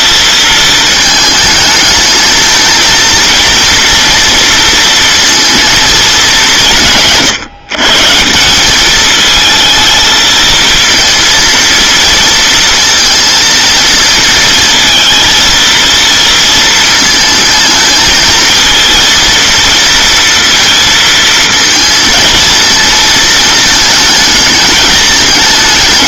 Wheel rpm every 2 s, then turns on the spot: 220, 230, 230, 200, 180, 230, 230, 220, 230, 220, 230, 220, 210.
none